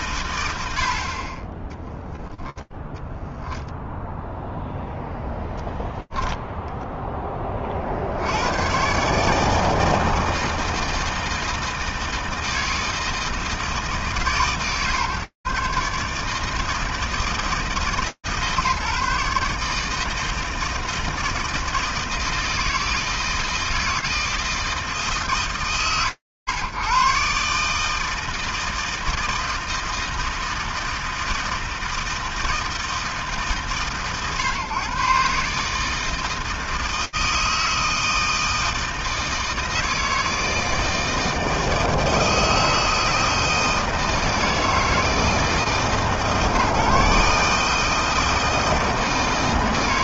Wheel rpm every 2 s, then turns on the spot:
100, 0, 0, 0, 100, 160, 160, 150, 160, 150, 160, 160, 160, 120, 160, 160, 160, 130, 160, 160, 160, 160, 160, 150, 160.
none